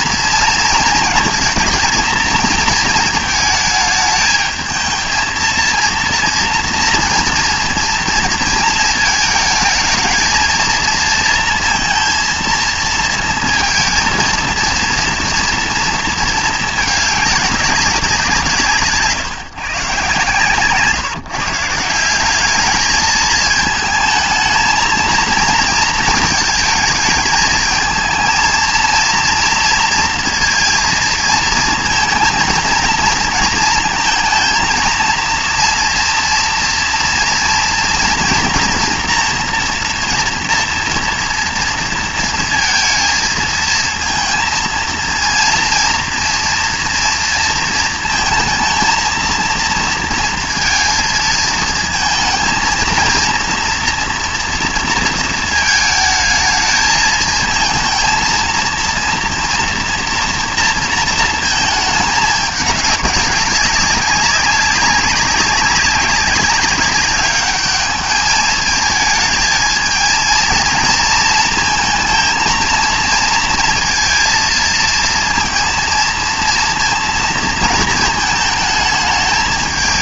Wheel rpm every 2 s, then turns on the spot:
230, 230, 220, 230, 230, 230, 230, 230, 220, 150, 150, 200, 230, 220, 230, 230, 230, 230, 230, 230, 230, 230, 230, 230, 220, 230, 230, 230, 220, 230, 230, 210, 190, 200, 220, 220, 220, 220, 230, 220.
none